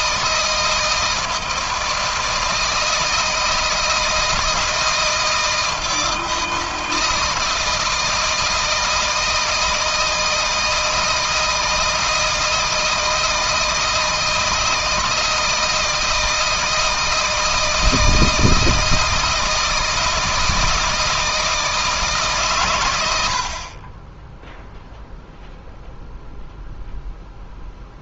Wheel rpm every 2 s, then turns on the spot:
160, 160, 160, 160, 160, 160, 160, 160, 160, 160, 160, 100, 0, 0.
none